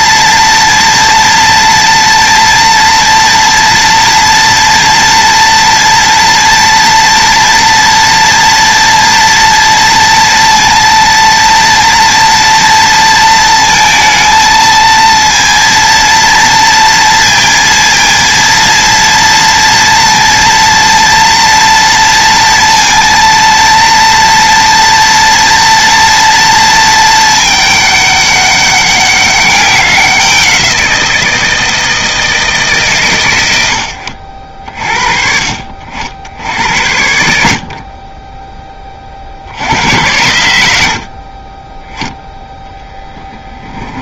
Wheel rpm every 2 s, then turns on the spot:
230, 230, 240, 230, 230, 230, 230, 230, 230, 230, 230, 230, 240, 220, 200, 170, 130, 50, 80, 20, 60, 10.
36-38 42-44